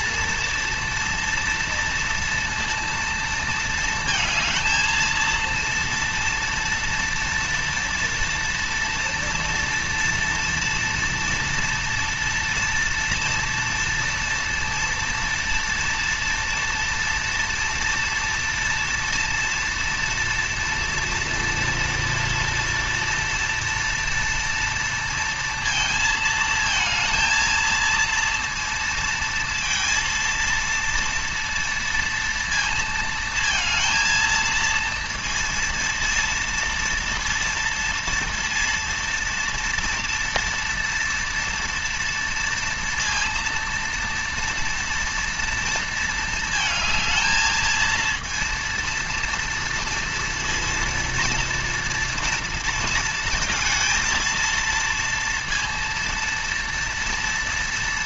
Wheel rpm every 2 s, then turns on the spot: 230, 230, 220, 230, 230, 230, 230, 230, 240, 230, 230, 230, 230, 220, 230, 230, 230, 230, 230, 230, 230, 230, 230, 220, 230, 230, 230, 230, 230.
none